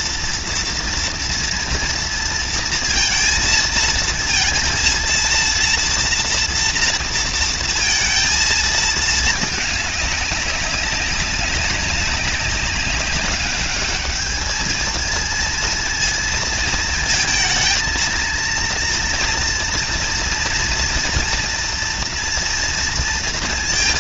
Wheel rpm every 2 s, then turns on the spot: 230, 230, 230, 230, 230, 200, 190, 220, 230, 230, 230, 230.
none